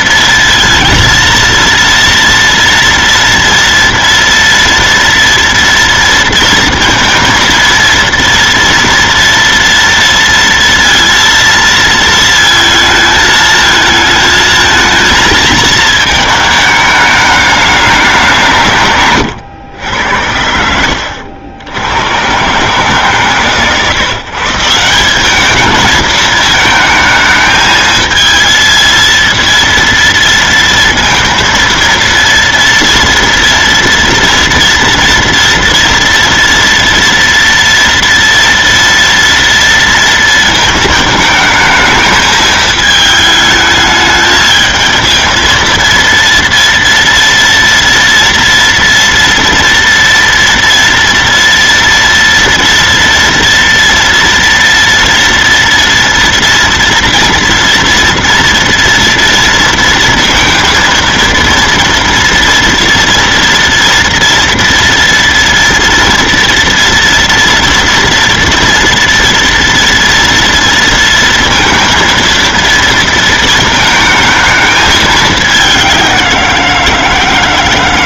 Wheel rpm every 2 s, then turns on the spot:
230, 230, 230, 230, 230, 230, 220, 220, 210, 160, 80, 130, 170, 220, 220, 230, 230, 240, 240, 230, 220, 220, 220, 230, 230, 230, 230, 230, 230, 230, 230, 230, 230, 230, 240, 230, 230, 220, 170.
none